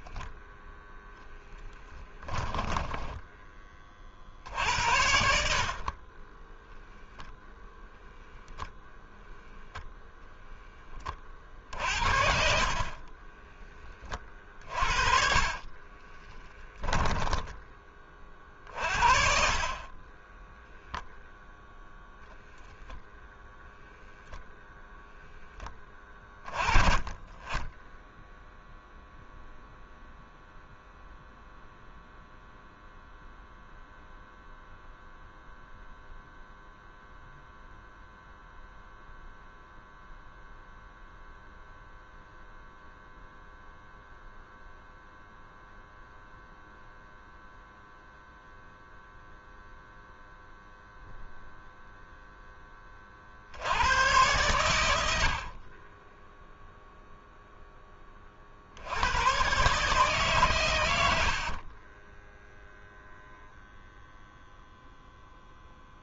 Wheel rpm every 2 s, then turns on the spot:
0, 10, 70, 0, 0, 20, 30, 40, 20, 40, 0, 0, 0, 20, 0, 0, 0, 0, 0, 0, 0, 0, 0, 0, 0, 0, 30, 90, 0, 80, 100, 0, 0.
4-6 12-18 60-62